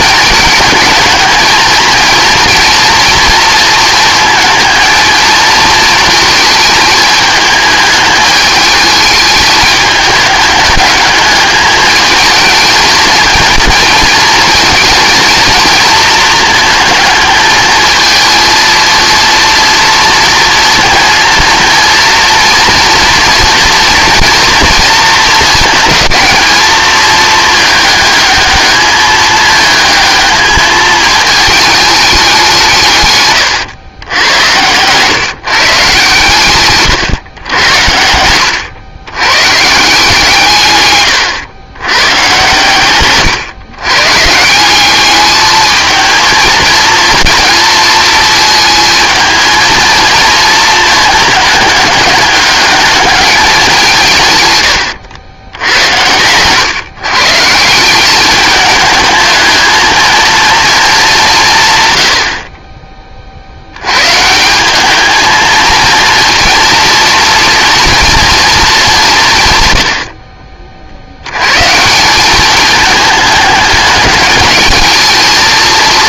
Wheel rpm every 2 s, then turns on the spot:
220, 230, 220, 220, 210, 210, 220, 230, 220, 230, 230, 230, 240, 220, 210, 220, 170, 110, 140, 100, 140, 130, 180, 220, 230, 230, 210, 110, 120, 210, 220, 30, 180, 230, 210, 40, 210, 210.
none